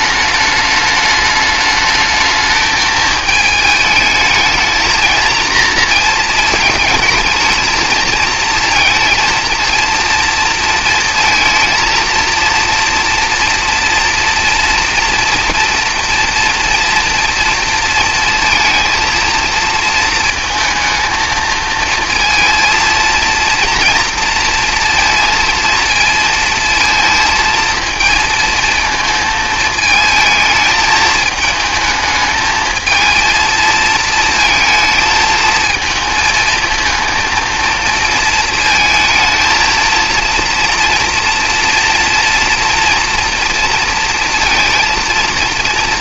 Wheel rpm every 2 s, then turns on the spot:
210, 210, 220, 220, 220, 230, 230, 230, 230, 230, 230, 230, 230, 230, 220, 220, 220, 220, 220, 220, 230, 240, 230.
none